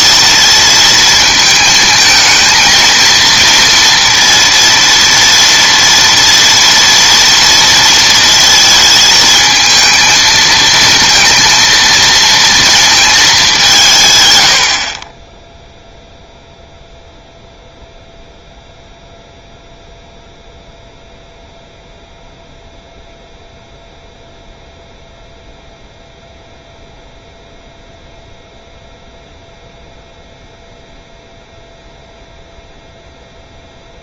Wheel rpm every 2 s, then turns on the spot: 230, 230, 230, 230, 230, 230, 230, 90, 0, 0, 0, 0, 0, 0, 0, 0, 0.
none